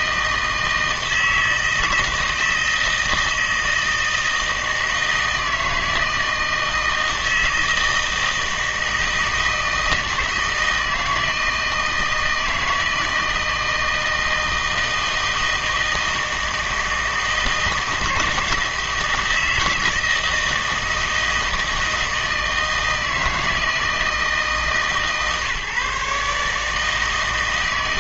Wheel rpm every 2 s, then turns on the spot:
160, 160, 160, 160, 160, 160, 160, 160, 160, 160, 160, 160, 160, 150.
none